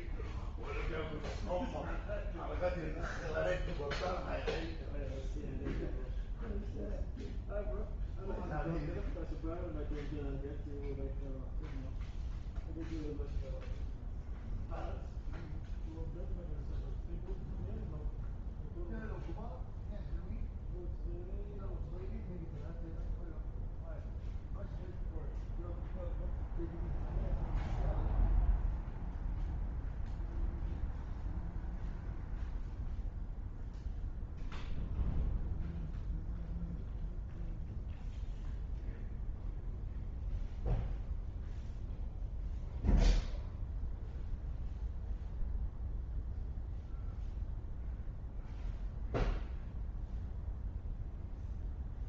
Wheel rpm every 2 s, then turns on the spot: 0, 0, 0, 0, 0, 0, 0, 0, 0, 0, 0, 0, 0, 0, 0, 0, 0, 0, 0, 0, 0, 0, 0, 0, 0, 0.
none